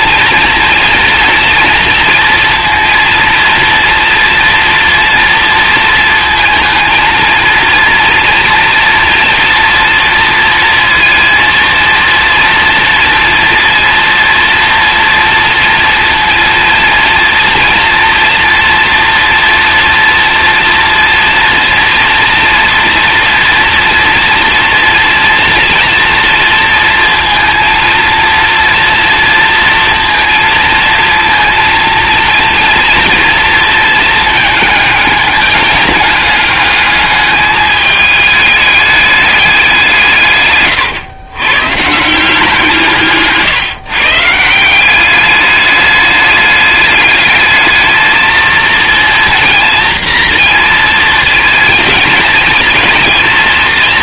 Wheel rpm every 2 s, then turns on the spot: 240, 230, 240, 230, 230, 230, 230, 240, 230, 240, 230, 230, 230, 230, 230, 230, 230, 210, 210, 210, 120, 170, 180, 210, 230, 230, 230.
none